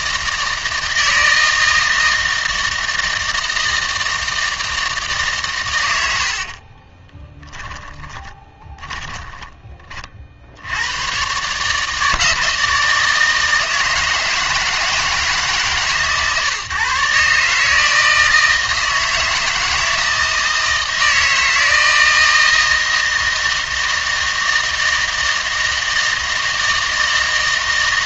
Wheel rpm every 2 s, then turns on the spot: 160, 160, 160, 40, 20, 80, 160, 160, 140, 160, 160, 160, 160, 160.
6-10